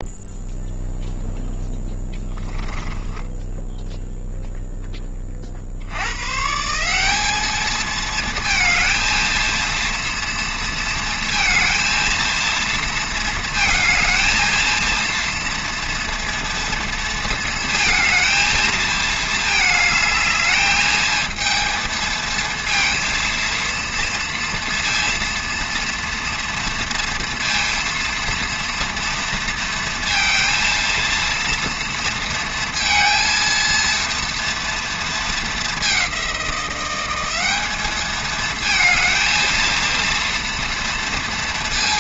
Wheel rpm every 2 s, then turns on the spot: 0, 10, 0, 160, 220, 230, 230, 220, 230, 230, 220, 230, 230, 230, 230, 230, 230, 230, 180, 220, 230.
none